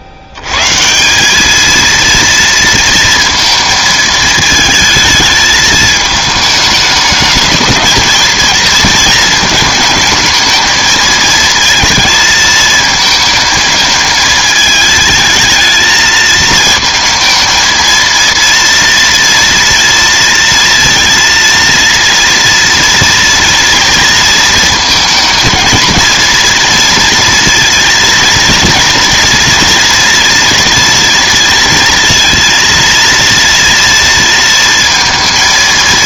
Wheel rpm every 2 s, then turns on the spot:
120, 230, 220, 210, 220, 220, 220, 220, 220, 230, 230, 230, 220, 240, 230, 230, 230, 230.
none